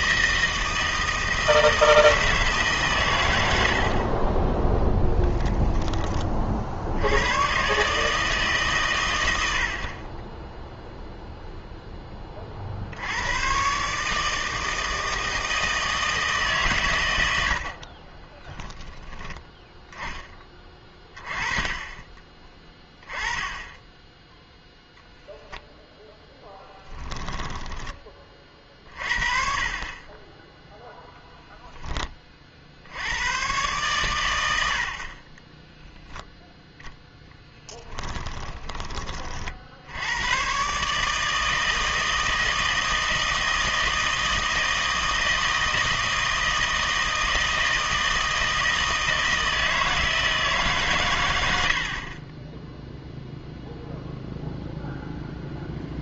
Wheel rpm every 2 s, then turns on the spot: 160, 150, 10, 60, 130, 0, 50, 160, 140, 10, 20, 20, 0, 0, 30, 10, 40, 80, 0, 20, 140, 160, 160, 160, 160, 150, 10, 0.
4-6